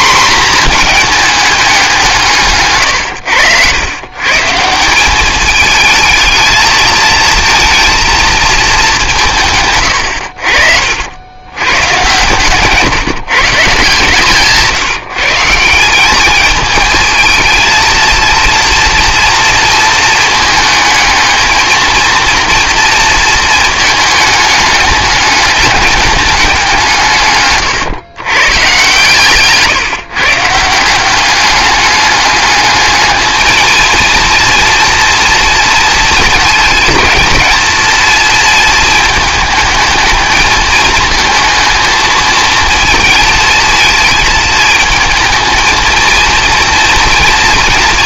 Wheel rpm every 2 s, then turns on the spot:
230, 130, 170, 220, 200, 60, 140, 160, 220, 230, 220, 230, 210, 180, 130, 160, 210, 230, 220, 230, 220, 220, 220, 230.
none